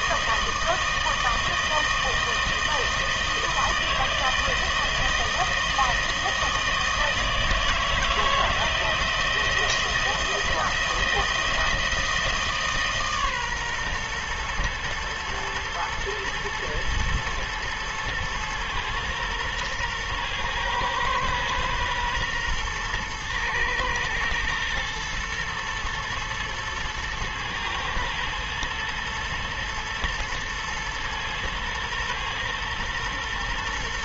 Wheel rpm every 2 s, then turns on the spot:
160, 160, 160, 160, 160, 170, 150, 110, 120, 120, 120, 120, 110, 110, 120, 110, 120.
none